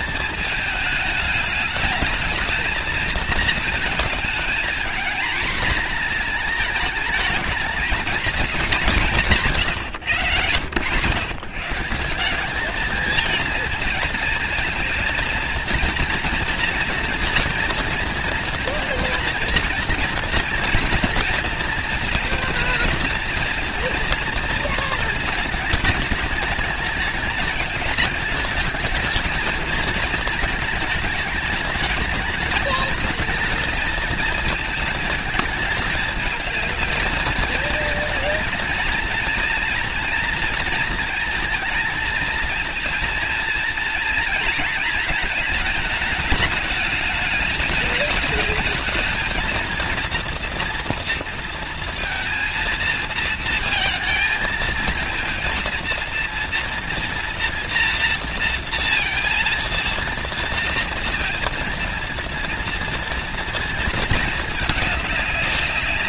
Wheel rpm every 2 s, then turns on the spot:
220, 220, 230, 230, 220, 120, 200, 230, 230, 230, 240, 230, 230, 210, 220, 220, 210, 230, 220, 230, 230, 230, 230, 210, 210, 230, 230, 220, 230, 230, 230, 230, 220.
none